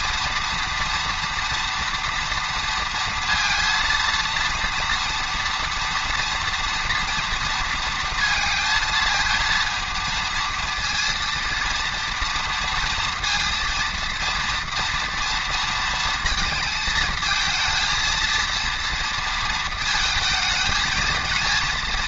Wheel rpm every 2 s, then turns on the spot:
230, 230, 230, 230, 230, 230, 230, 230, 230, 230, 220.
none